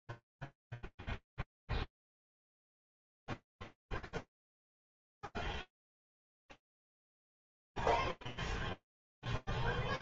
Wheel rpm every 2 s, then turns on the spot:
0, 0, 0, 0, 0.
none